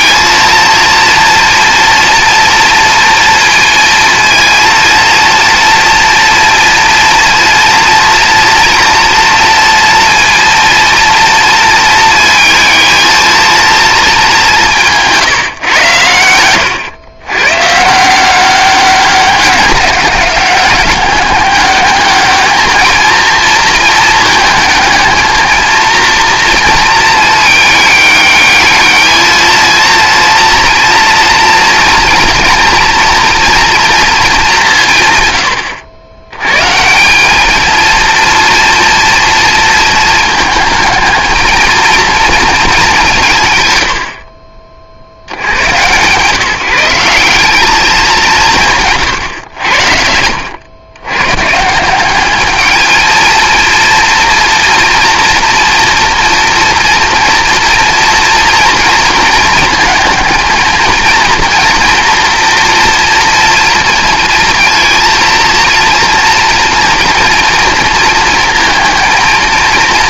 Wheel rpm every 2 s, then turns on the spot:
230, 230, 230, 230, 230, 230, 220, 160, 100, 190, 200, 220, 220, 230, 210, 230, 230, 170, 150, 230, 210, 200, 50, 160, 150, 100, 220, 230, 230, 230, 220, 240, 230, 230, 230.
none